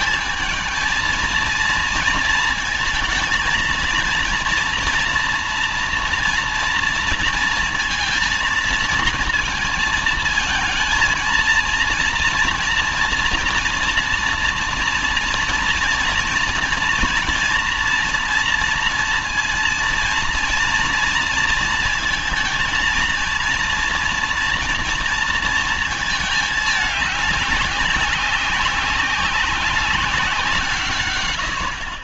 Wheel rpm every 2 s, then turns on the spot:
220, 230, 230, 230, 220, 220, 230, 230, 230, 230, 230, 230, 240, 210, 190, 150.
none